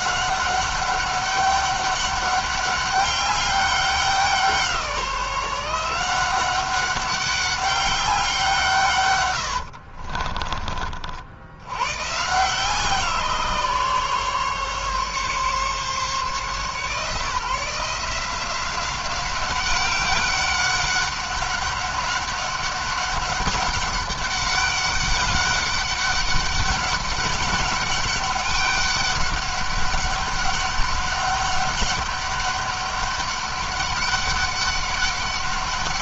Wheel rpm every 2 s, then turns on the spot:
190, 200, 180, 190, 140, 50, 150, 140, 150, 180, 200, 200, 200, 200, 200, 200, 200, 200.
none